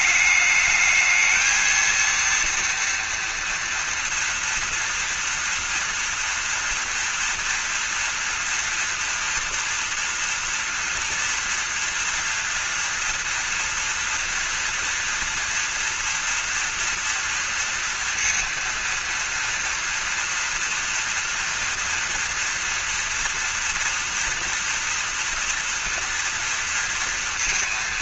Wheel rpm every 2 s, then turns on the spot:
220, 230, 230, 230, 230, 240, 240, 230, 230, 230, 230, 230, 240, 230.
none